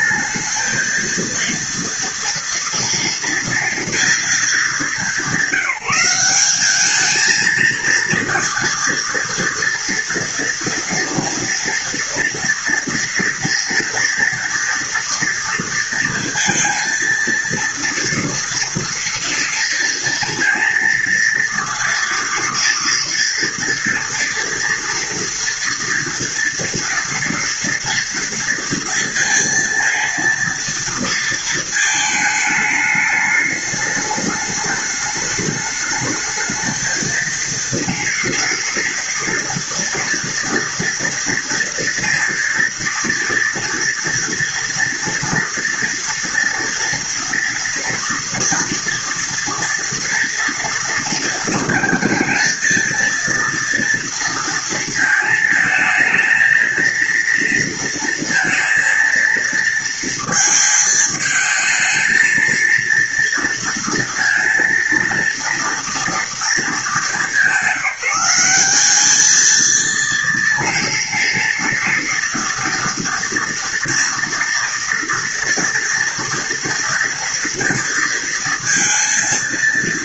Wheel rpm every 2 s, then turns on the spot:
220, 230, 210, 200, 230, 230, 230, 230, 230, 230, 230, 230, 230, 230, 230, 230, 210, 210, 220, 230, 230, 230, 230, 230, 230, 230, 230, 230, 230, 230, 220, 230, 230, 220, 190, 230, 230, 230, 240, 230.
none